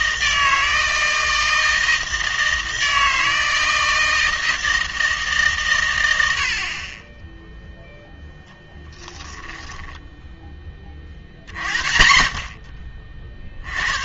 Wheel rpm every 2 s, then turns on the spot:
160, 160, 160, 50, 10, 20, 30.
8-10